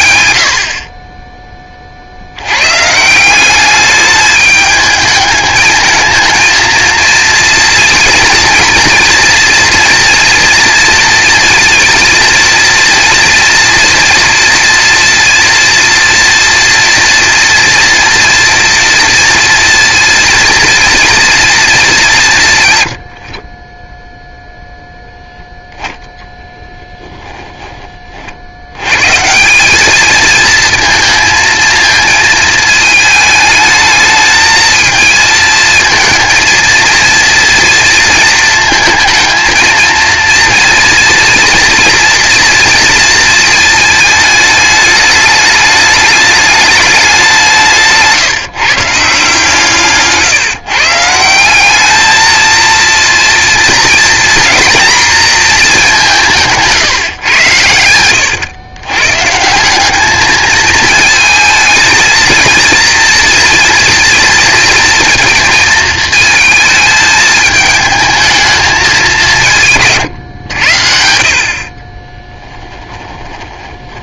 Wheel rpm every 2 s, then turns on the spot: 90, 110, 210, 220, 230, 230, 230, 230, 230, 240, 230, 130, 0, 10, 90, 230, 220, 220, 230, 220, 230, 230, 220, 210, 150, 160, 230, 240, 160, 110, 220, 230, 230, 220, 220, 90, 10.
72-74